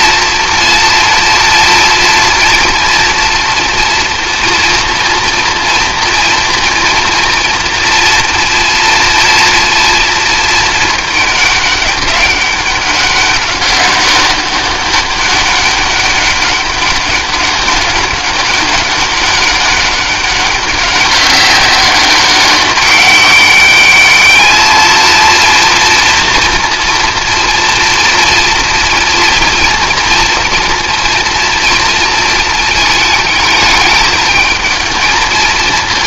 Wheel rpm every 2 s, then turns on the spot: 230, 230, 230, 230, 230, 220, 200, 200, 200, 190, 200, 200, 220, 230, 230, 240, 220, 220.
none